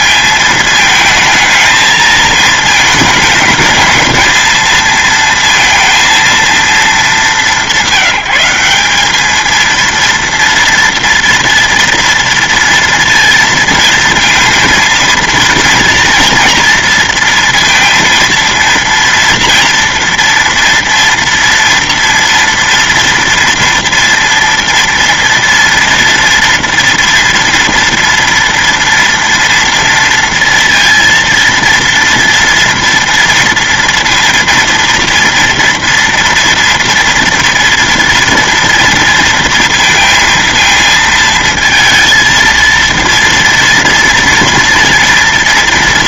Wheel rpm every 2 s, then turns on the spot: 220, 220, 230, 220, 190, 230, 230, 230, 230, 230, 230, 230, 230, 230, 230, 230, 230, 230, 230, 230, 230, 230, 230.
none